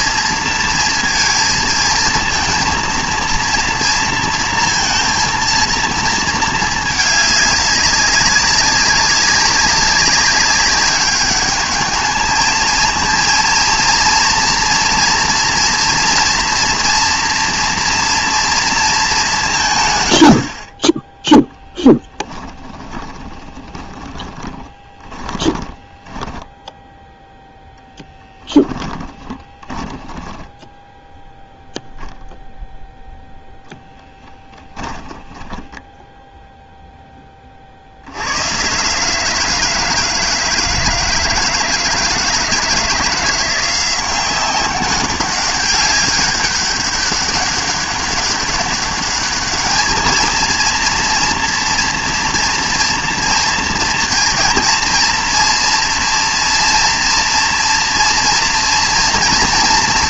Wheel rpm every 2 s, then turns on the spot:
230, 230, 230, 210, 190, 200, 230, 240, 240, 230, 50, 20, 20, 10, 10, 10, 0, 10, 0, 130, 160, 160, 190, 200, 200, 230, 230, 230, 240, 230.
22-32 34-36